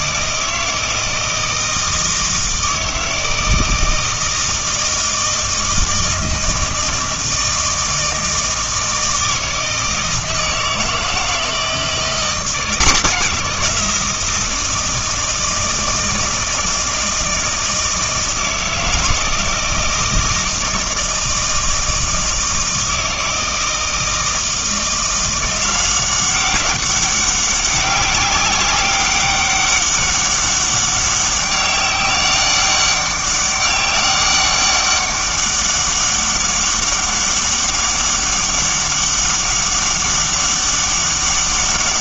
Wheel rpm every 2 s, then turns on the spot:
160, 160, 160, 160, 160, 160, 180, 160, 160, 160, 160, 160, 170, 200, 200, 200, 200, 200, 200, 200, 200.
none